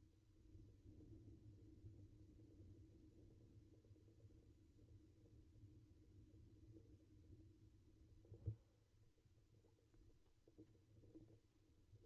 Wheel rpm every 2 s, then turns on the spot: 0, 0, 0, 0, 0, 0.
none